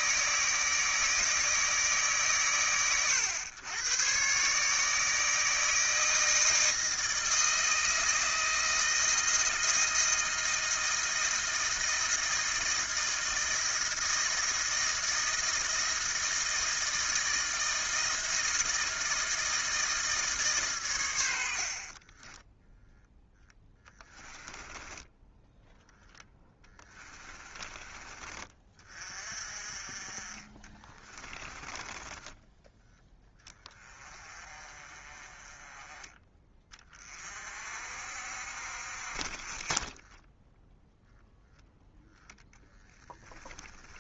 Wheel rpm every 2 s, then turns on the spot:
160, 100, 160, 160, 160, 160, 160, 160, 160, 160, 100, 0, 10, 20, 30, 20, 10, 30, 30, 40, 0, 10.
26-28 30-32 42-44